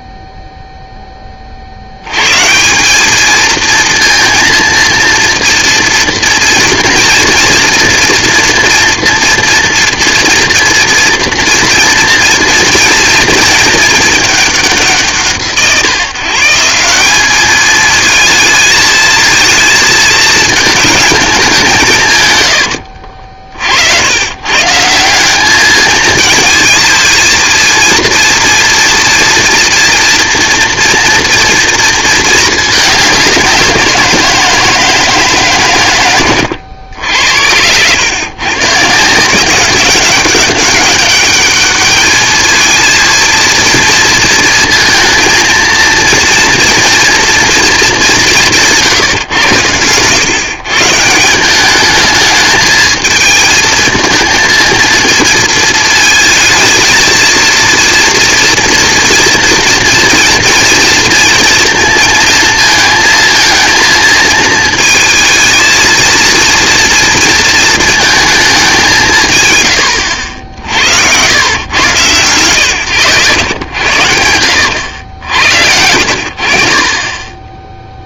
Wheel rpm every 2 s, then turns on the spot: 0, 160, 230, 230, 230, 240, 230, 190, 180, 220, 220, 90, 150, 220, 230, 230, 220, 170, 90, 130, 200, 220, 230, 230, 170, 140, 220, 220, 220, 230, 230, 230, 220, 230, 200, 70, 110, 80, 50.
22-24 36-38 74-76